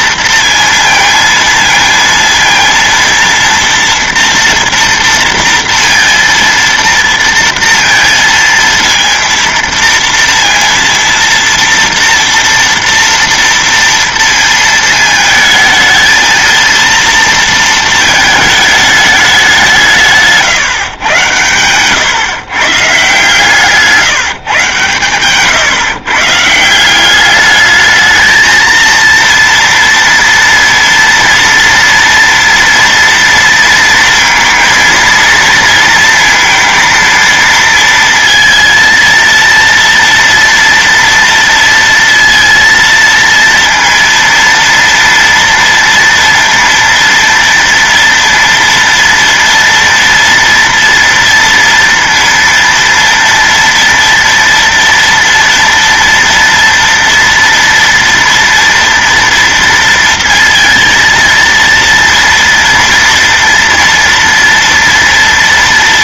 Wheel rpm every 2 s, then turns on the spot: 230, 230, 230, 230, 230, 230, 230, 230, 230, 220, 150, 140, 140, 160, 230, 230, 230, 230, 230, 230, 230, 230, 230, 230, 230, 230, 230, 240, 230, 230, 230, 230, 230.
20-22